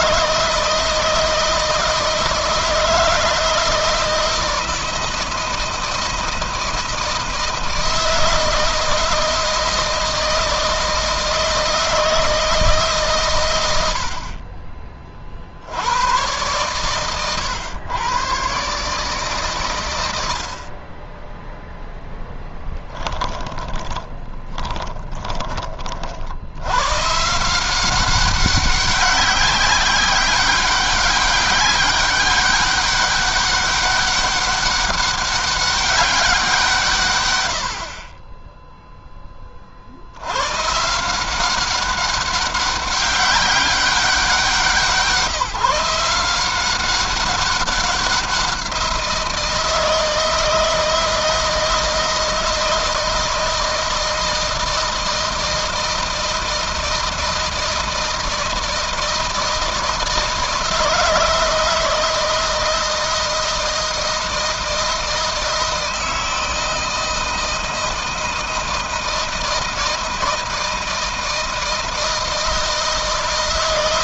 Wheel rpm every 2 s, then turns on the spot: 160, 160, 160, 160, 160, 160, 150, 40, 120, 140, 40, 10, 20, 120, 190, 200, 200, 200, 150, 10, 160, 200, 170, 180, 170, 160, 160, 160, 160, 160, 160, 160, 160, 160, 160, 160, 160.
22-26